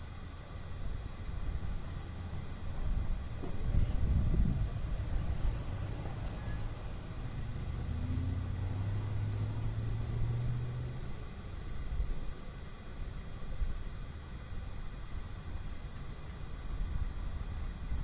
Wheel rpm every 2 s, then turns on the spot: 0, 0, 0, 0, 0, 0, 0, 0, 0.
none